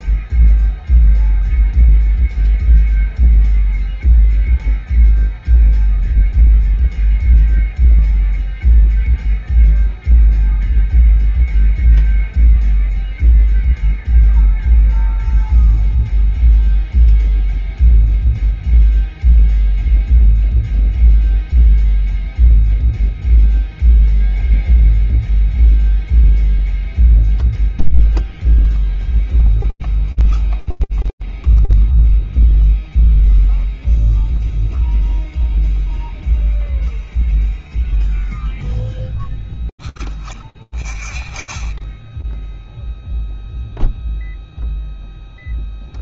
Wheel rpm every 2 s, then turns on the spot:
0, 0, 0, 0, 0, 0, 0, 0, 0, 0, 0, 0, 0, 0, 0, 0, 0, 0, 0, 0, 0, 0, 0.
none